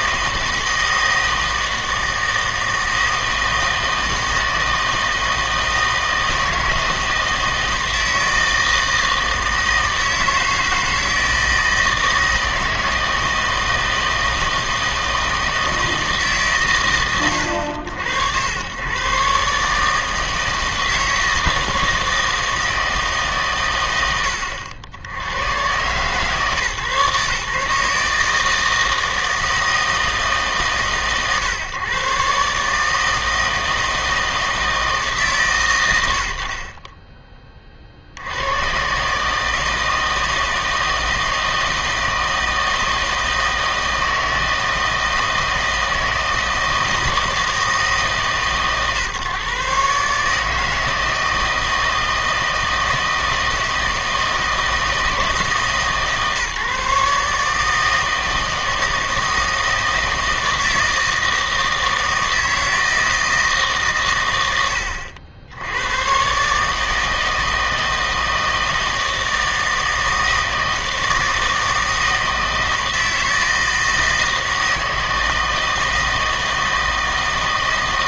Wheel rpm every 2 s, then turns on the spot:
160, 160, 160, 160, 160, 160, 160, 160, 120, 100, 160, 160, 90, 140, 160, 150, 150, 160, 40, 110, 160, 160, 160, 160, 130, 160, 160, 160, 140, 160, 160, 160, 100, 150, 160, 160, 160, 160, 160.
36-38